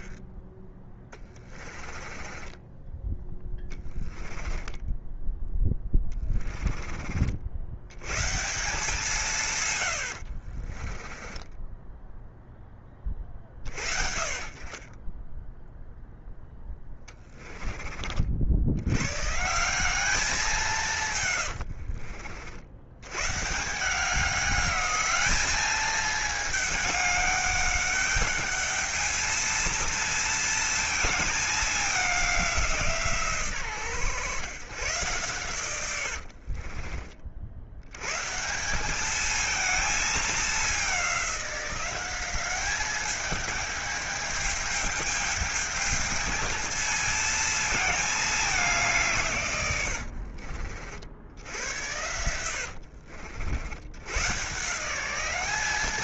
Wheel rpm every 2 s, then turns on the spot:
10, 20, 10, 40, 170, 30, 20, 20, 10, 90, 160, 100, 200, 210, 220, 230, 160, 120, 40, 190, 200, 210, 210, 230, 180, 60, 70, 170.
0-2 4-6 10-12 16-18 36-38 52-54